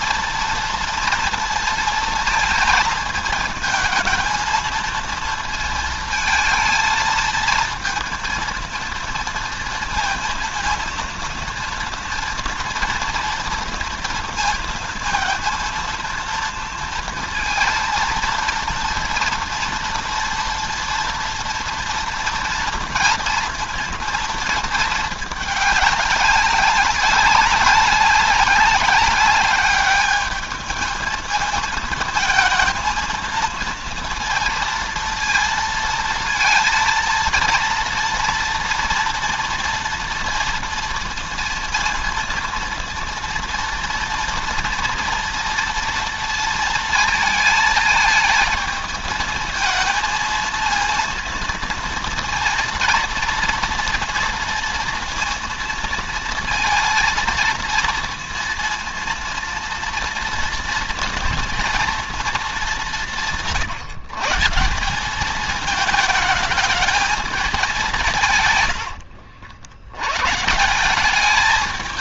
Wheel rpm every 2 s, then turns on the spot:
230, 220, 230, 230, 230, 230, 230, 230, 230, 230, 230, 230, 220, 190, 200, 220, 230, 230, 230, 230, 230, 230, 230, 230, 220, 230, 230, 230, 230, 230, 230, 200, 180, 220, 100, 170.
none